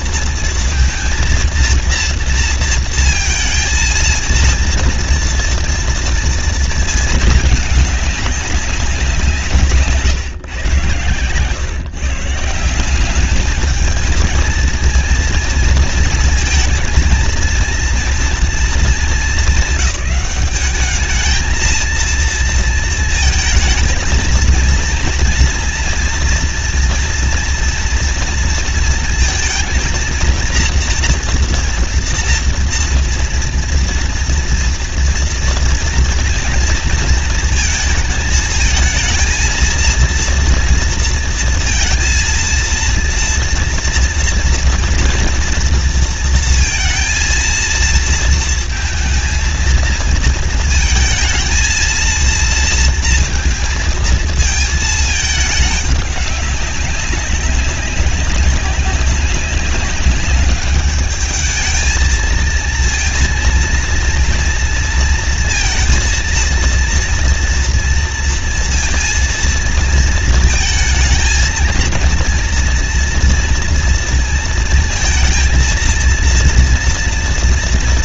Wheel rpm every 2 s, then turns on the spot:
230, 230, 230, 230, 200, 120, 160, 230, 220, 230, 200, 230, 230, 240, 230, 230, 230, 230, 230, 220, 230, 230, 230, 230, 230, 220, 230, 220, 200, 190, 200, 220, 230, 230, 230, 220, 230, 230, 230.
none